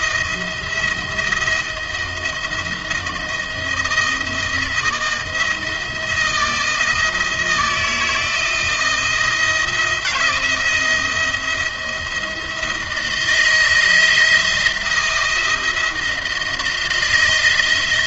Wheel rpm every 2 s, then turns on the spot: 170, 160, 170, 170, 170, 170, 160, 170, 170.
none